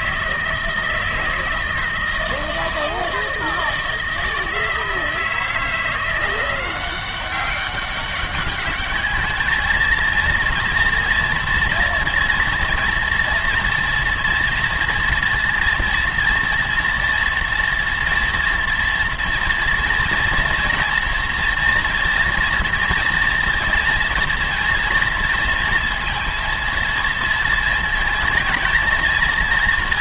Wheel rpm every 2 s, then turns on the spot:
160, 160, 160, 180, 200, 230, 240, 230, 240, 240, 240, 230, 240, 230, 220.
none